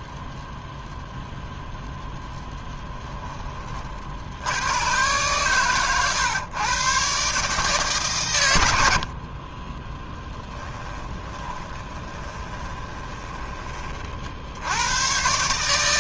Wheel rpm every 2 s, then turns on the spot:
0, 10, 110, 120, 80, 20, 20, 90.
10-14